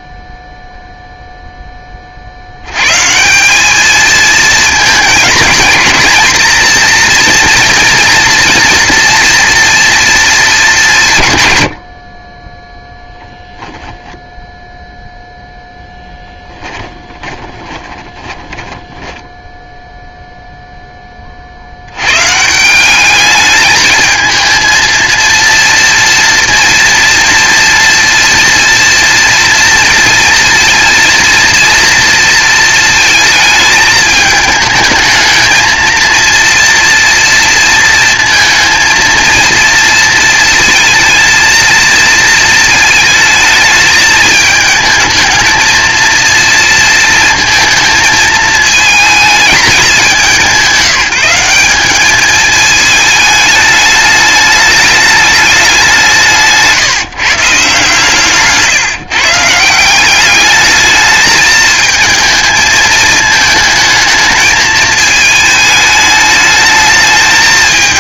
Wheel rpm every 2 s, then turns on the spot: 0, 90, 220, 230, 240, 180, 10, 0, 10, 10, 0, 170, 230, 230, 230, 230, 230, 220, 230, 230, 230, 220, 220, 230, 220, 180, 220, 210, 160, 140, 210, 220, 220, 210.
12-14 16-20